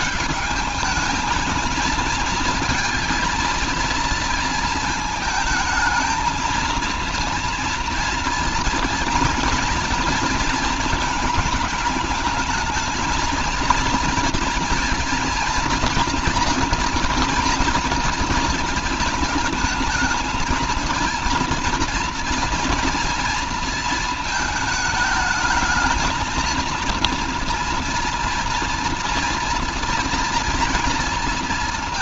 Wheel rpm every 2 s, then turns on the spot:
210, 230, 220, 230, 230, 230, 220, 230, 230, 230, 230, 230, 220, 230, 230, 230.
none